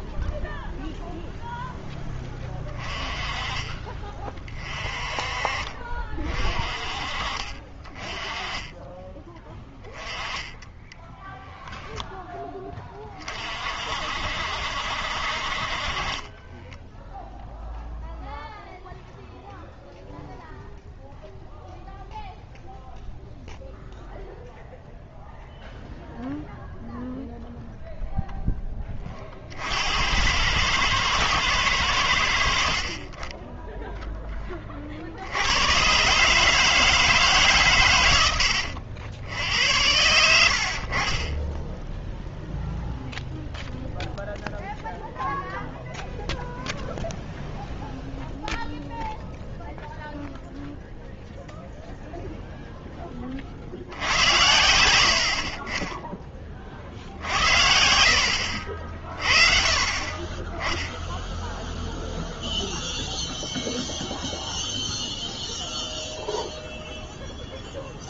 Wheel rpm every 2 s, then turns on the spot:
0, 20, 30, 40, 20, 10, 10, 60, 10, 0, 0, 0, 0, 0, 0, 100, 60, 20, 150, 90, 40, 0, 0, 0, 0, 0, 0, 110, 40, 60, 10, 0, 0, 0.
10-12 16-18 58-60